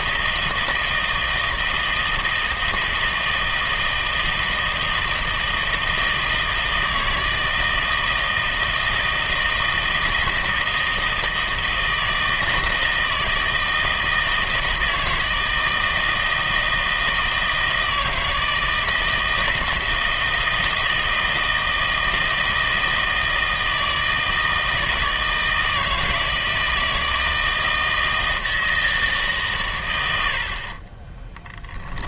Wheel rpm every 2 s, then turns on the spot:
160, 160, 160, 160, 160, 160, 160, 160, 160, 160, 160, 160, 160, 160, 160, 40.
30-32